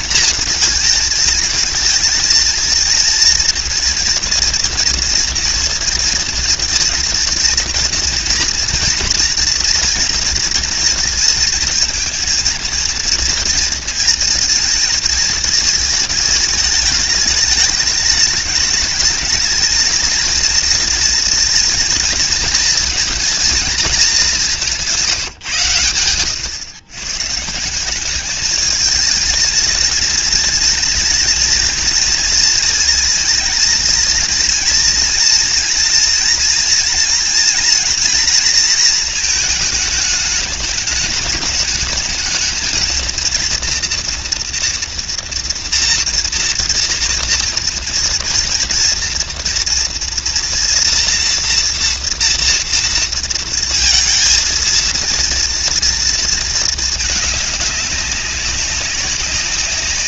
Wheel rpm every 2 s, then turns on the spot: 230, 230, 230, 220, 230, 230, 230, 230, 210, 210, 230, 230, 190, 110, 210, 230, 230, 230, 230, 240, 210, 220, 230, 230, 230, 240, 230, 230, 220, 190.
none